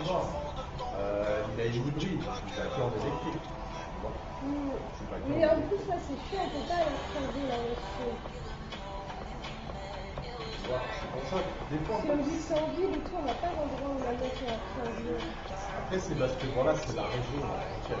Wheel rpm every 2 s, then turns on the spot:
0, 0, 0, 0, 0, 0, 0, 0, 0.
none